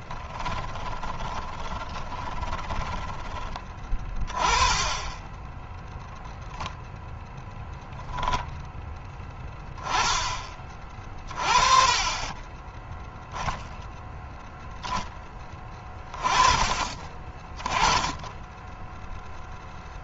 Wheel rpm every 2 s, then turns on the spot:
20, 20, 20, 0, 0, 30, 10, 10, 30, 10.
0-2